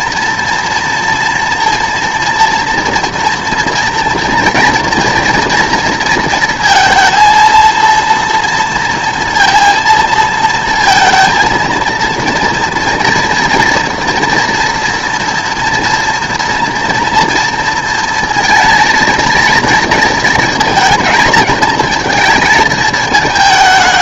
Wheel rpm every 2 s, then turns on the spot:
240, 230, 230, 230, 230, 230, 230, 240, 230, 230, 220, 220.
none